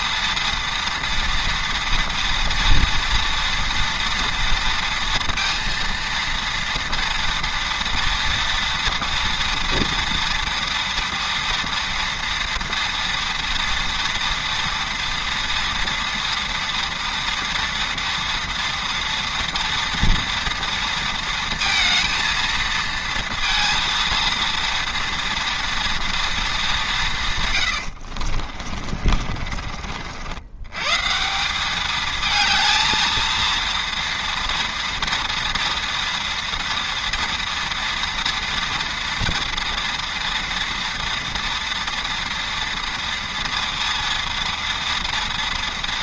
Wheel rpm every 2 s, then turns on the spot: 230, 230, 230, 230, 240, 230, 230, 230, 230, 230, 230, 230, 230, 150, 40, 180, 230, 230, 230, 230, 230, 230, 230.
28-30